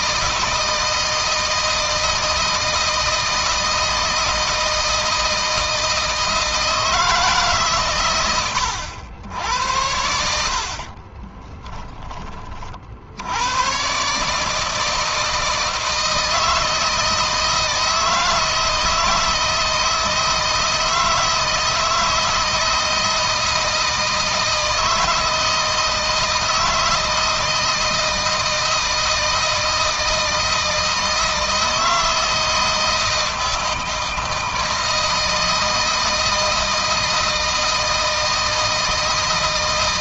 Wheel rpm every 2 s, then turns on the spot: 160, 160, 160, 160, 100, 60, 40, 160, 160, 160, 160, 160, 160, 160, 160, 160, 160, 160, 160, 160.
10-12